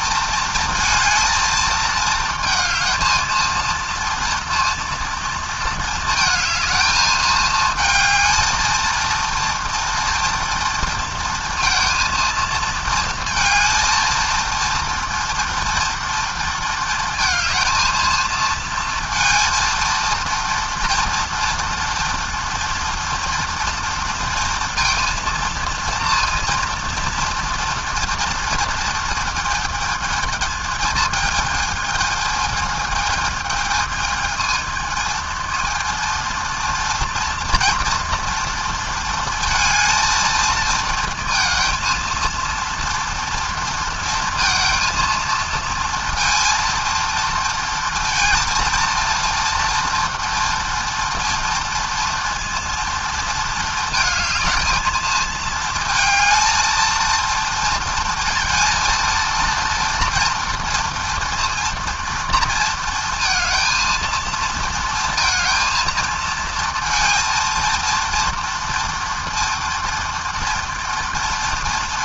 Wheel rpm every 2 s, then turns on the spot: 230, 230, 230, 220, 230, 230, 230, 230, 220, 230, 230, 230, 230, 230, 230, 220, 220, 230, 240, 230, 230, 230, 230, 230, 240, 230, 230, 220, 230, 230, 230, 230, 230, 230, 230, 230.
none